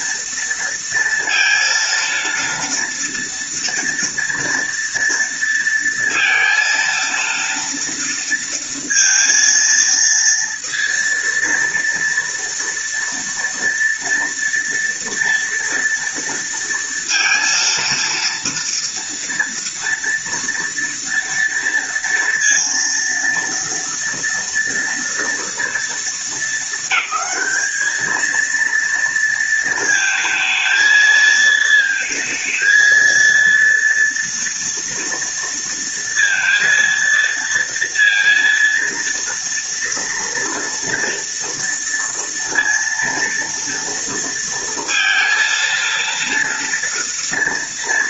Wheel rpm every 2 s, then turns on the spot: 230, 230, 230, 230, 230, 230, 240, 240, 230, 230, 230, 230, 230, 200, 230, 220, 230, 230, 230, 230, 230, 230, 230, 230.
none